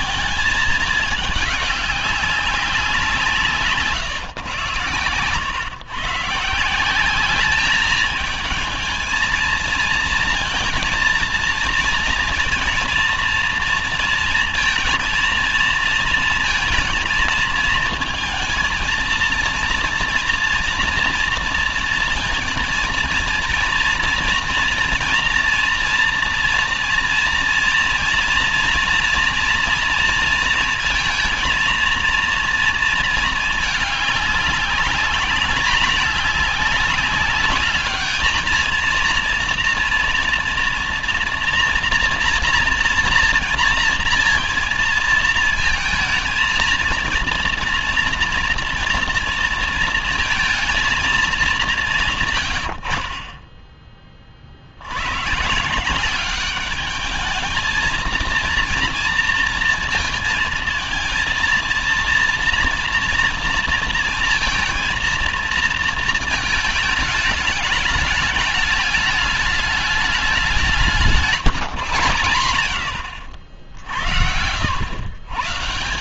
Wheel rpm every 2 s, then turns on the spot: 220, 190, 120, 160, 220, 230, 230, 230, 230, 220, 230, 230, 230, 230, 230, 230, 230, 200, 200, 220, 230, 240, 230, 220, 230, 230, 130, 40, 210, 230, 230, 230, 230, 220, 210, 190, 110, 80.
none